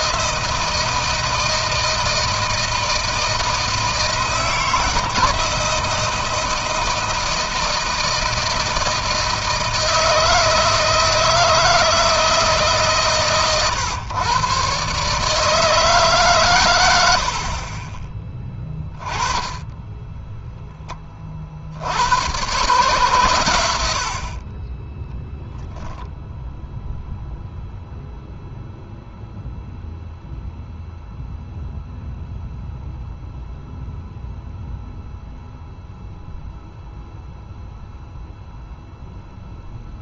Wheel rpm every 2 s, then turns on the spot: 160, 160, 160, 160, 160, 160, 150, 130, 110, 20, 10, 120, 20, 0, 0, 0, 0, 0, 0, 0.
none